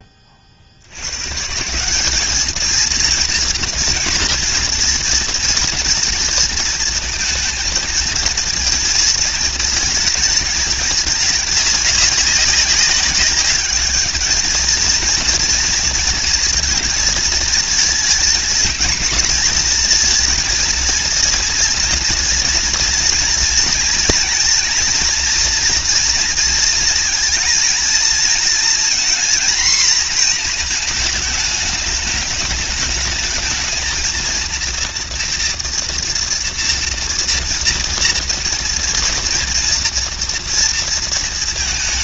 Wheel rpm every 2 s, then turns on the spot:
110, 230, 230, 230, 230, 210, 210, 230, 230, 230, 230, 230, 230, 230, 230, 220, 220, 230, 230, 240, 230.
none